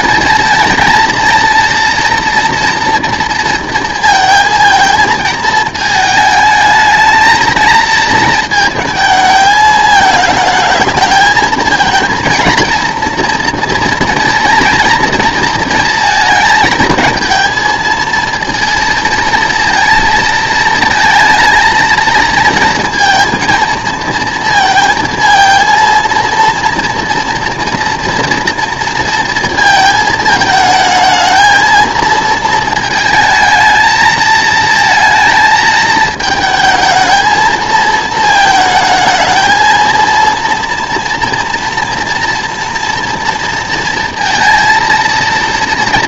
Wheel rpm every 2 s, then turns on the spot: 230, 230, 220, 220, 220, 220, 230, 230, 220, 230, 230, 220, 230, 230, 230, 220, 230, 230, 220, 220, 230, 230, 230.
none